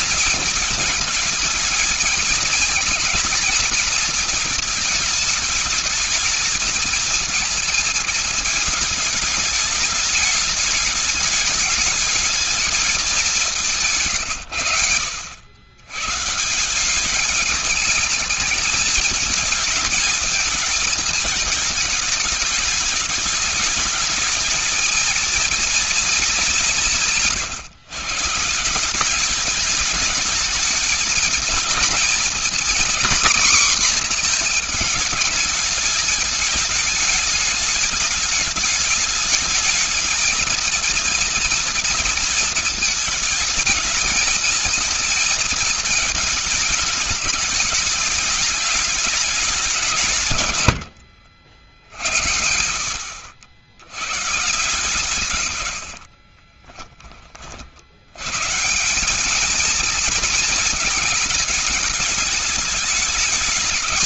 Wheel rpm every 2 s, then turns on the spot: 220, 230, 220, 230, 210, 210, 220, 110, 170, 210, 220, 210, 220, 170, 170, 220, 240, 230, 210, 210, 230, 230, 230, 220, 210, 120, 80, 140, 30, 140, 220, 210.
50-52 56-58